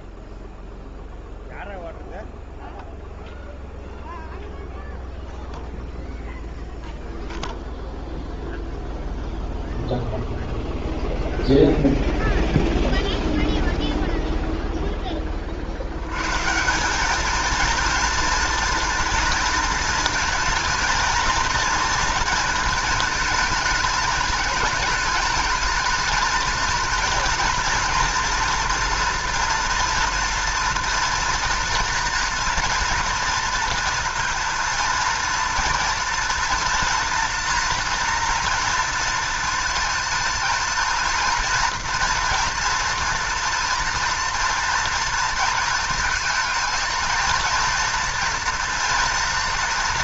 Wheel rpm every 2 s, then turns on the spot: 0, 0, 0, 0, 0, 0, 0, 0, 170, 230, 230, 220, 220, 220, 230, 230, 240, 230, 230, 230, 230, 230, 230, 230, 240.
none